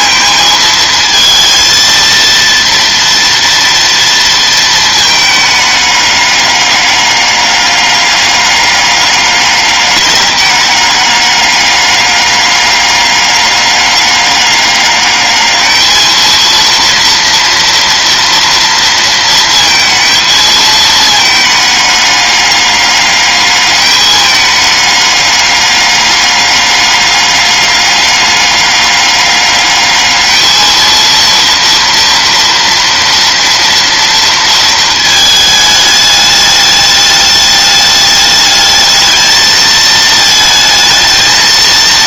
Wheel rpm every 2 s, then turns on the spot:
220, 230, 230, 200, 200, 200, 200, 200, 230, 230, 220, 200, 210, 200, 200, 220, 230, 230, 210, 210, 220.
none